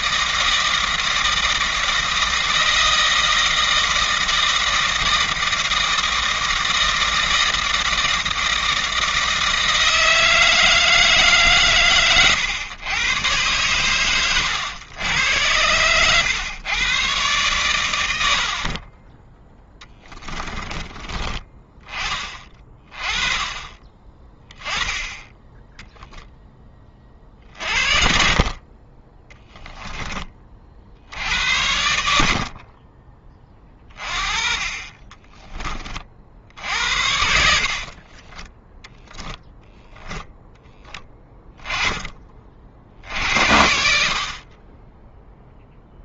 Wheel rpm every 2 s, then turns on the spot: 160, 160, 160, 160, 160, 160, 120, 90, 130, 30, 20, 20, 10, 30, 20, 50, 30, 20, 70, 10, 10, 50, 20.
18-20 36-38